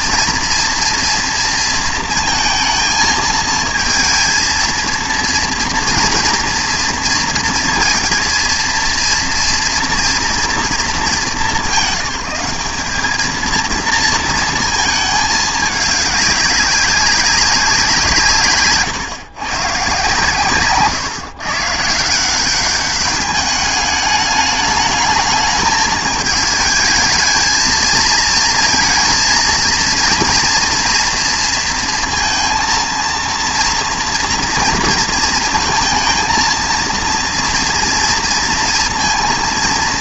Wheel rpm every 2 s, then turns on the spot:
230, 230, 230, 230, 230, 230, 210, 220, 200, 140, 130, 190, 210, 220, 230, 230, 230, 230, 220, 230.
none